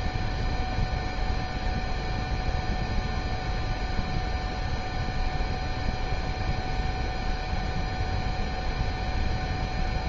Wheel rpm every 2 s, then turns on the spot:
0, 0, 0, 0, 0.
none